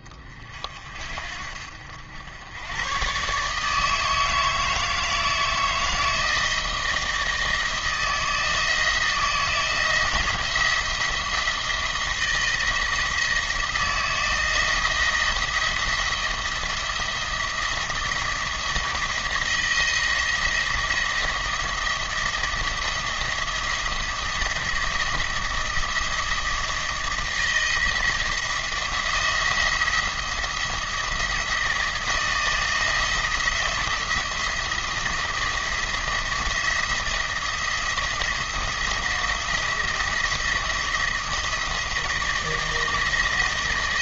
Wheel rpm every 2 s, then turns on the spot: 50, 110, 160, 160, 160, 170, 160, 160, 170, 170, 170, 170, 170, 170, 160, 170, 160, 170, 170, 170, 170, 160.
none